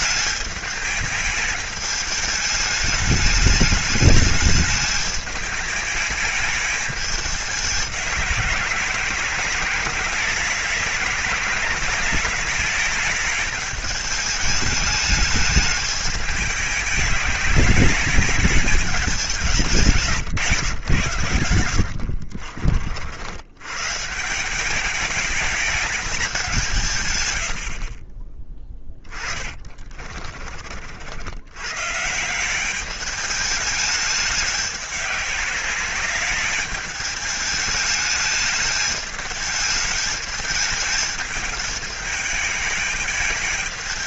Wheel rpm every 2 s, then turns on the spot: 210, 210, 210, 210, 190, 200, 210, 220, 210, 200, 130, 60, 200, 150, 20, 60, 200, 200, 210, 210, 210, 210.
28-30